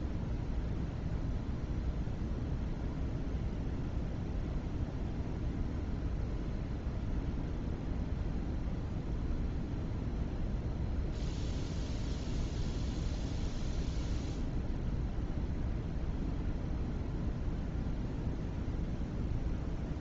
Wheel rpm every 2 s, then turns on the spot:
0, 0, 0, 0, 0, 0, 0, 0, 0, 0.
none